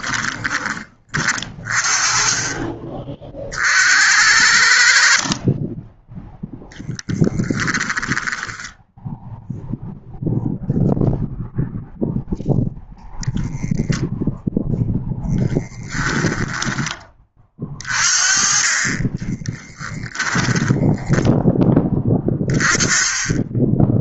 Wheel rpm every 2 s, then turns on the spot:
30, 30, 60, 10, 10, 0, 0, 0, 20, 30, 10, 20.
18-22